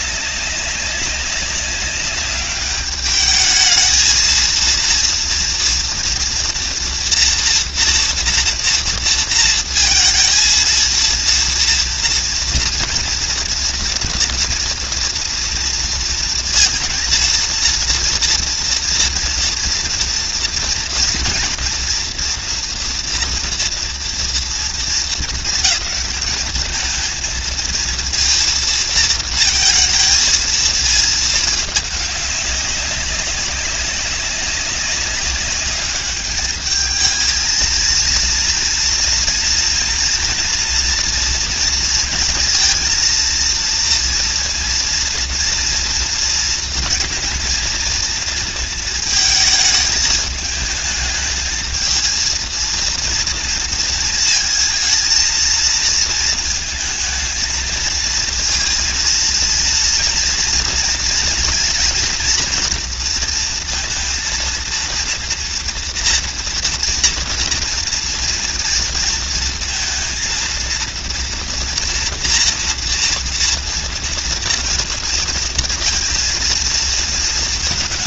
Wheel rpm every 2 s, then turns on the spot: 190, 200, 230, 240, 230, 230, 240, 230, 230, 240, 240, 240, 230, 220, 230, 220, 200, 190, 210, 230, 230, 230, 230, 230, 230, 220, 230, 230, 230, 230, 240, 230, 230, 240, 230, 230, 230, 230, 230.
none